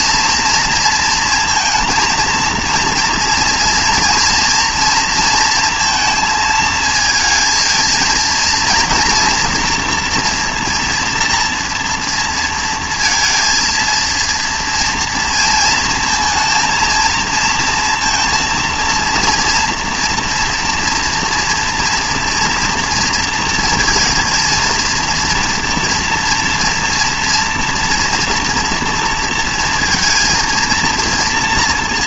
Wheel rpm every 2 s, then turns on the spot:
230, 230, 230, 220, 230, 240, 230, 230, 230, 230, 230, 230, 230, 230, 230, 230.
none